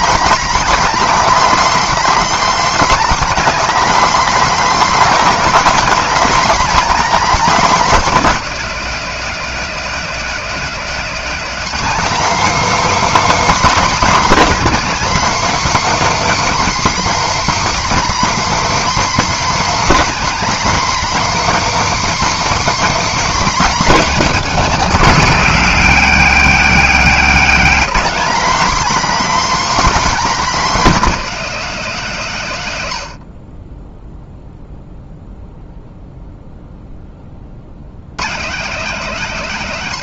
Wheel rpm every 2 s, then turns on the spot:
290, 300, 270, 280, 250, 240, 300, 300, 310, 300, 300, 300, 260, 250, 280, 270, 110, 0, 10, 230.
none